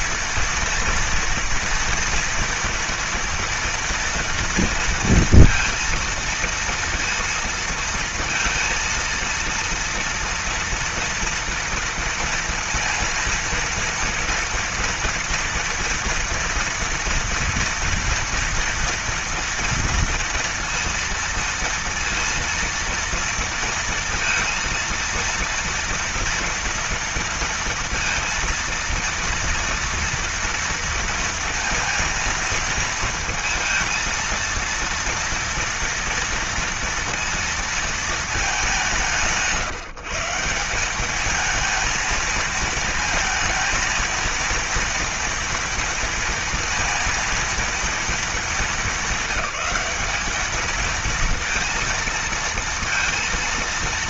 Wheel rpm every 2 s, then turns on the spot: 230, 230, 230, 230, 230, 230, 230, 240, 230, 230, 230, 230, 230, 230, 230, 230, 230, 230, 230, 180, 190, 230, 230, 230, 210, 220, 230.
none